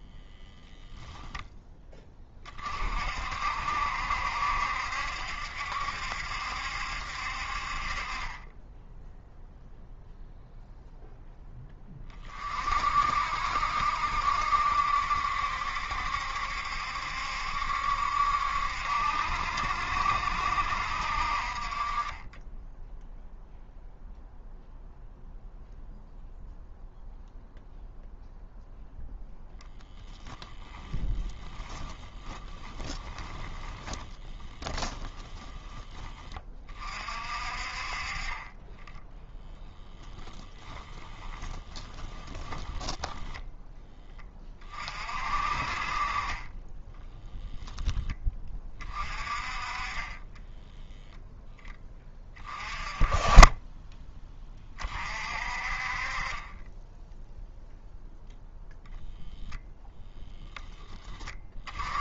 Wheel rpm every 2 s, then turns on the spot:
0, 50, 70, 70, 10, 0, 50, 70, 70, 70, 60, 10, 0, 0, 0, 10, 10, 20, 40, 10, 20, 10, 30, 10, 30, 0, 20, 30, 10, 0, 10.
30-36 40-44 46-48